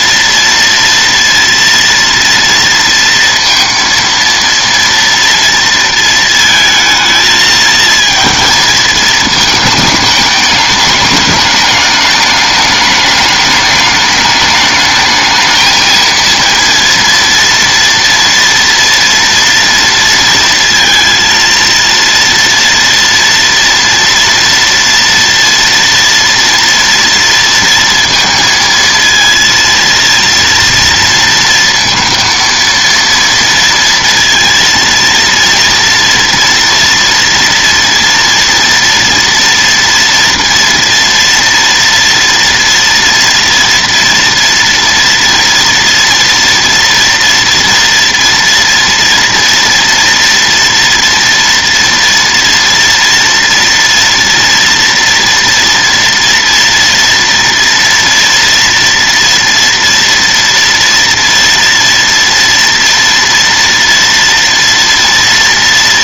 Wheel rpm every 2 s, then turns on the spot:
230, 230, 230, 220, 220, 210, 210, 210, 230, 230, 230, 230, 240, 230, 230, 230, 230, 230, 230, 230, 230, 240, 230, 230, 230, 230, 230, 230, 230, 230, 230, 230, 230.
none